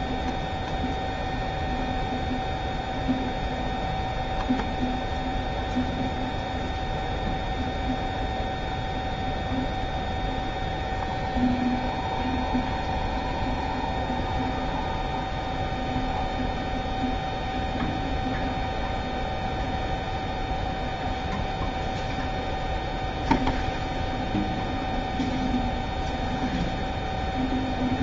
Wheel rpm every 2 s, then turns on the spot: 0, 0, 0, 0, 0, 0, 0, 0, 0, 0, 0, 0, 0, 0.
none